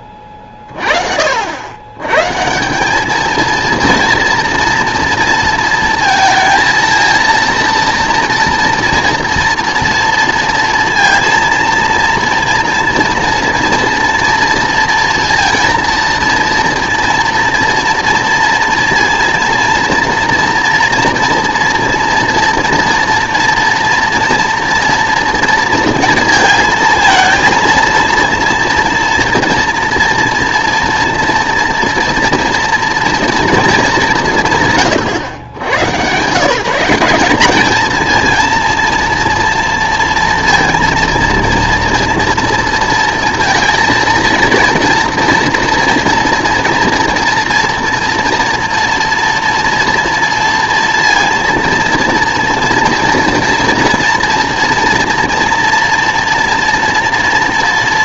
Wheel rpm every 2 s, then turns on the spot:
30, 160, 230, 230, 230, 230, 230, 230, 230, 230, 240, 230, 230, 230, 230, 230, 230, 150, 160, 230, 230, 240, 230, 230, 230, 230, 230, 230, 230.
none